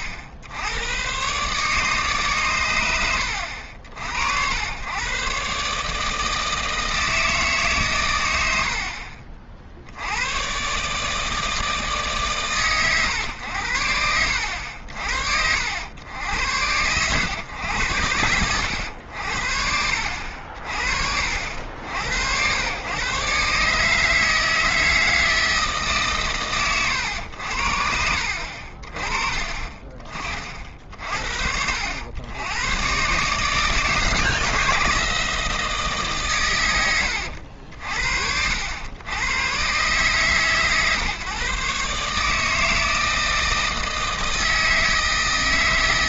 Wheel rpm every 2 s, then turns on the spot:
80, 120, 100, 160, 70, 120, 120, 80, 90, 90, 60, 110, 160, 120, 50, 40, 110, 160, 100, 80, 140, 160, 160.
none